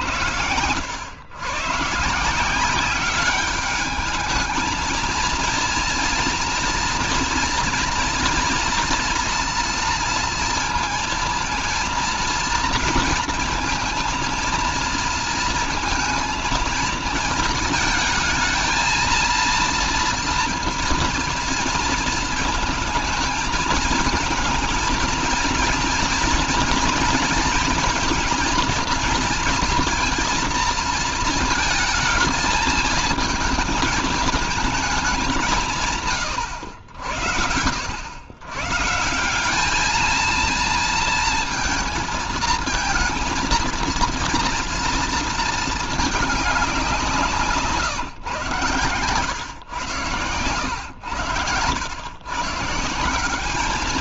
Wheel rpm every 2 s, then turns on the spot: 100, 180, 220, 240, 230, 230, 230, 230, 220, 220, 230, 220, 220, 230, 230, 230, 220, 220, 100, 150, 220, 220, 230, 190, 120, 90, 150.
none